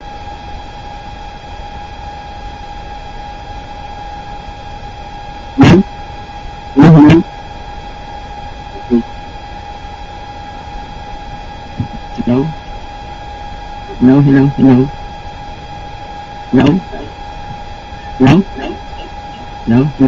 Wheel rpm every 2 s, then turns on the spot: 0, 0, 0, 0, 0, 0, 0, 0, 0, 0.
none